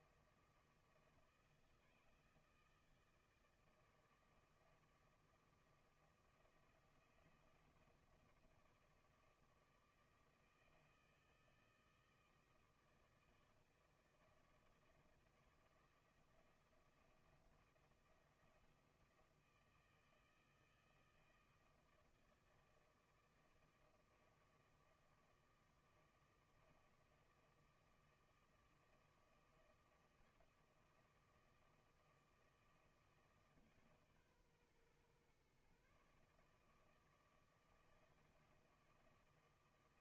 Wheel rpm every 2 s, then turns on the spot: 160, 160, 160, 170, 160, 160, 160, 160, 170, 170, 160, 160, 160, 160, 160, 160, 160, 130, 160, 160.
none